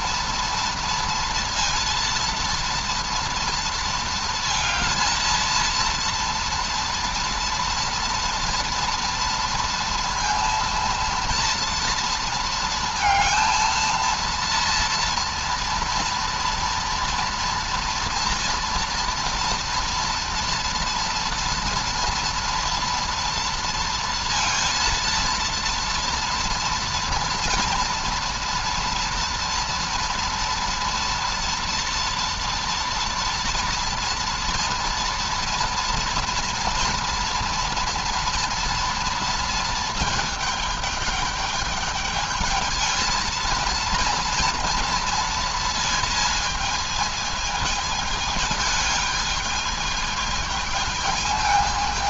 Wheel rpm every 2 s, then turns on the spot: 230, 230, 230, 230, 230, 230, 230, 230, 230, 230, 230, 230, 230, 230, 230, 230, 230, 230, 230, 230, 210, 220, 230, 220, 220, 220.
none